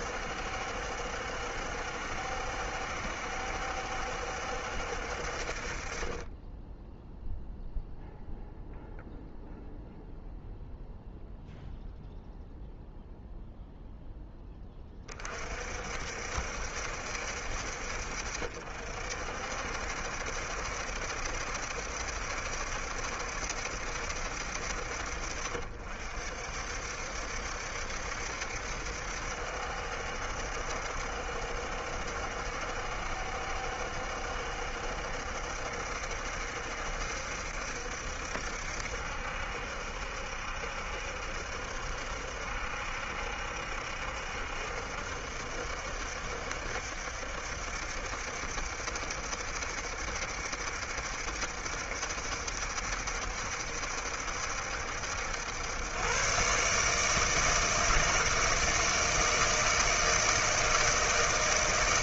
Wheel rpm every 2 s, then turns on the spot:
70, 70, 70, 10, 0, 0, 0, 20, 70, 60, 70, 70, 60, 60, 70, 70, 70, 70, 70, 70, 70, 70, 70, 70, 70, 70, 70, 70, 140, 160, 160.
none